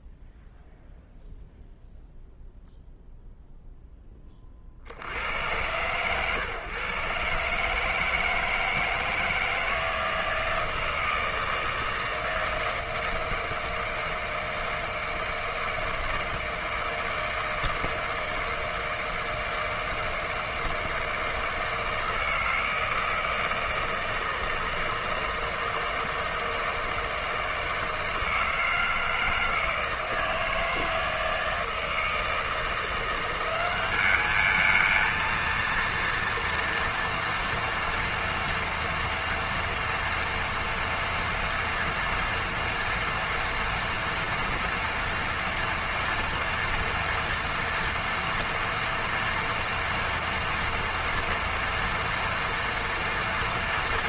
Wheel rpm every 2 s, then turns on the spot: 0, 0, 50, 140, 160, 160, 160, 160, 160, 160, 160, 160, 160, 160, 160, 160, 170, 220, 230, 230, 230, 240, 230, 230, 230, 230, 230.
none